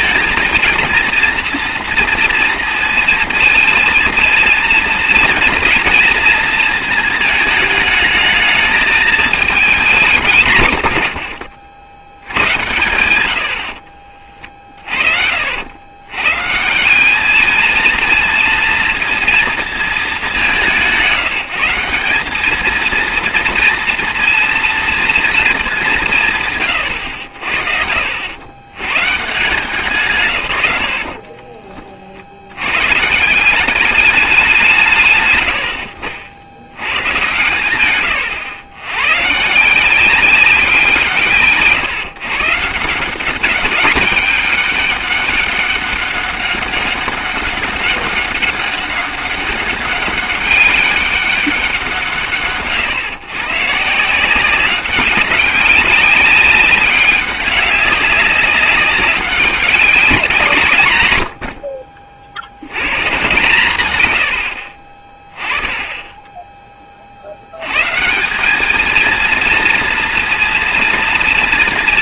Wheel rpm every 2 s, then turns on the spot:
230, 230, 230, 220, 210, 110, 90, 40, 180, 230, 190, 220, 230, 120, 120, 90, 110, 160, 100, 110, 170, 170, 200, 200, 200, 200, 140, 190, 200, 200, 130, 120, 50, 30, 220, 230.
none